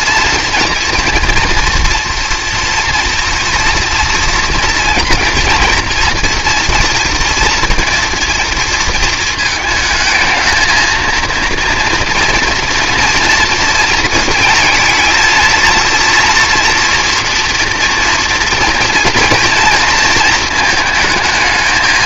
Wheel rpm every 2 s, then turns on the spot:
230, 240, 230, 240, 230, 220, 230, 220, 230, 230, 220.
none